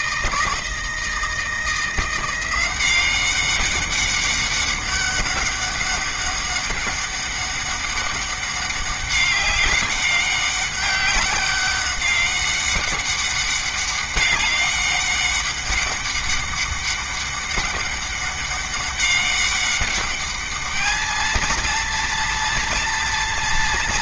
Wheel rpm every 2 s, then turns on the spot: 160, 190, 200, 200, 200, 200, 200, 200, 200, 200, 220, 230.
none